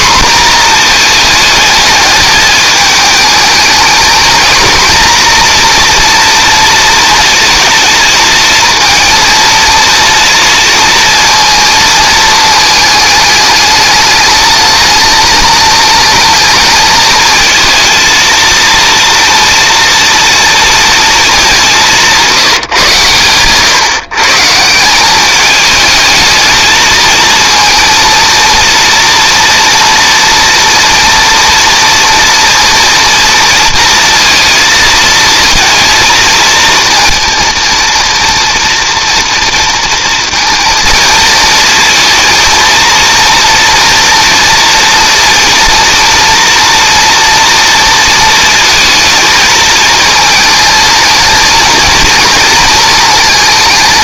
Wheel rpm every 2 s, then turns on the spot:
230, 220, 230, 230, 230, 230, 210, 220, 220, 230, 230, 150, 170, 220, 230, 230, 230, 230, 230, 230, 230, 230, 240, 240, 230, 230, 220.
none